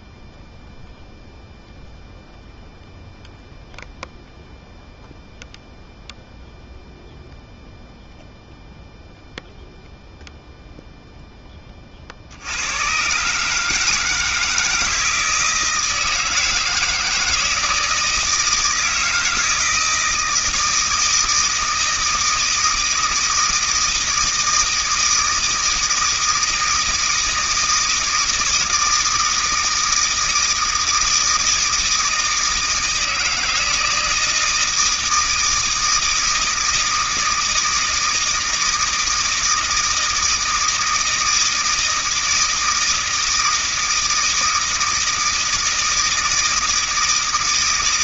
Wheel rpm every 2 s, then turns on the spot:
0, 0, 0, 0, 0, 0, 80, 160, 160, 160, 160, 160, 160, 160, 160, 160, 160, 160, 160, 160, 160, 160, 160, 160.
none